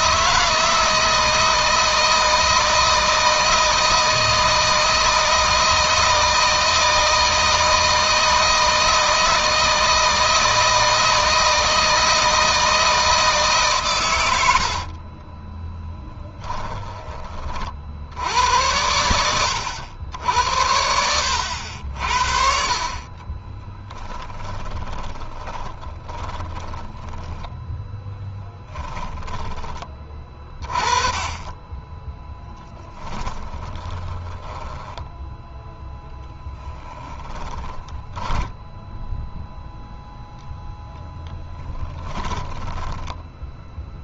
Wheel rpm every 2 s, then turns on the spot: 160, 160, 160, 160, 160, 160, 160, 70, 10, 90, 80, 50, 10, 10, 10, 20, 10, 10, 20, 10, 0, 10.
14-16 22-30 32-40 42-44